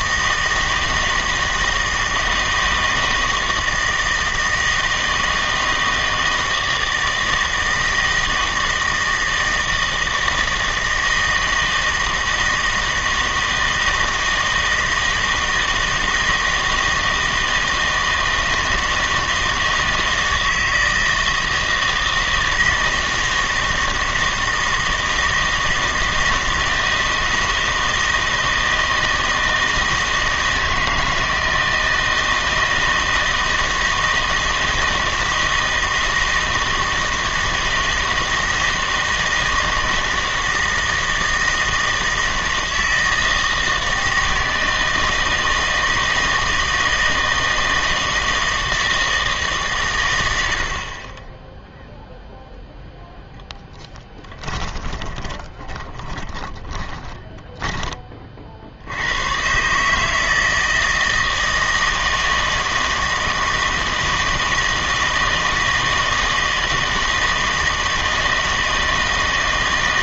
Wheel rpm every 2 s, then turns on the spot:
160, 160, 160, 160, 160, 160, 160, 160, 160, 160, 160, 160, 160, 160, 160, 160, 160, 160, 160, 160, 160, 160, 160, 160, 160, 60, 0, 10, 20, 60, 160, 160, 160, 160, 160.
54-58